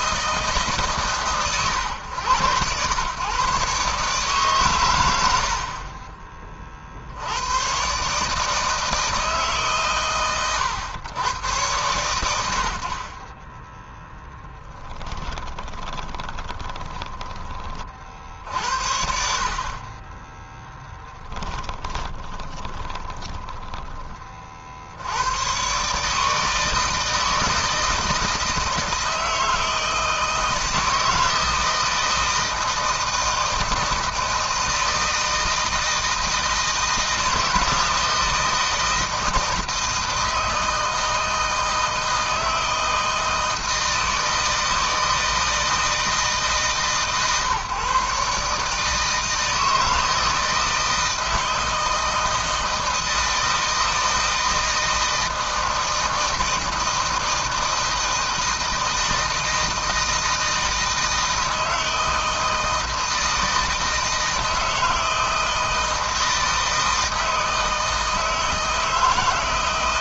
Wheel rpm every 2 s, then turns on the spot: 150, 120, 110, 60, 160, 120, 60, 20, 20, 60, 10, 20, 80, 160, 160, 160, 160, 160, 160, 160, 160, 160, 160, 140, 160, 160, 160, 160, 160, 160, 160, 160, 160, 160, 140.
14-18 20-24